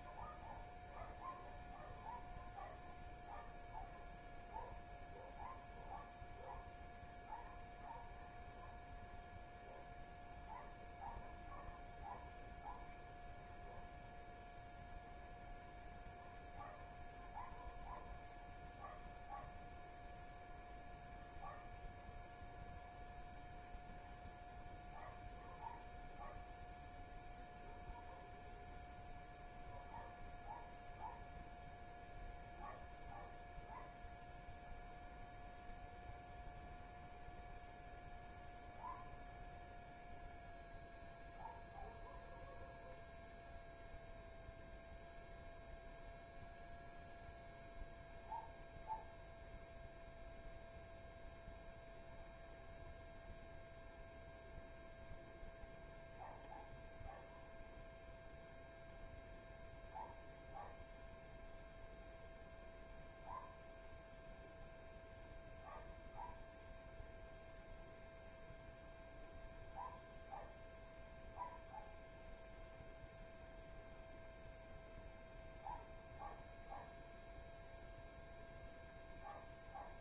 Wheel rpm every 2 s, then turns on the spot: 0, 0, 0, 0, 0, 0, 0, 0, 0, 0, 0, 0, 0, 0, 0, 0, 0, 0, 0, 0, 0, 0, 0, 0, 0, 0, 0, 0, 0, 0, 0, 0, 0, 0, 0, 0, 0, 0, 0, 0.
none